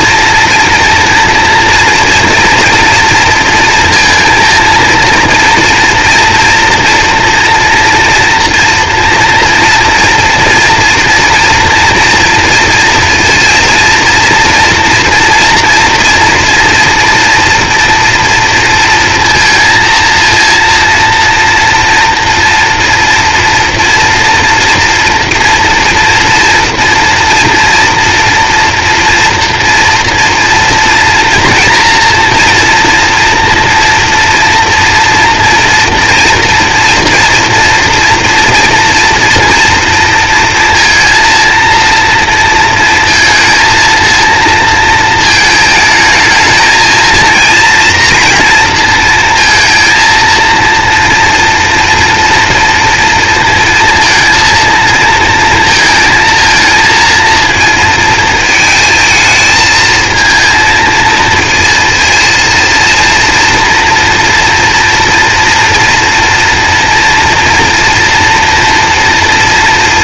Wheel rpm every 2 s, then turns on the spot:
230, 230, 230, 230, 230, 240, 230, 230, 240, 230, 230, 230, 230, 230, 230, 230, 240, 230, 230, 230, 230, 230, 230, 220, 230, 230, 230, 230, 220, 220, 230, 230, 230, 240, 230.
none